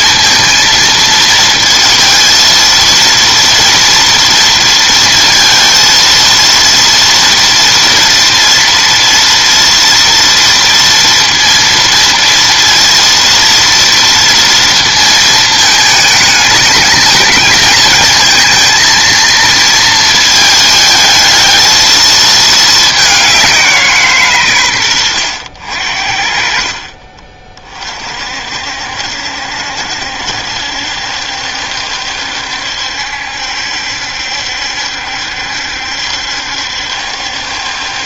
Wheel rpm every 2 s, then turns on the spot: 230, 230, 230, 230, 230, 230, 230, 230, 220, 230, 220, 220, 120, 40, 50, 70, 70, 70, 70.
none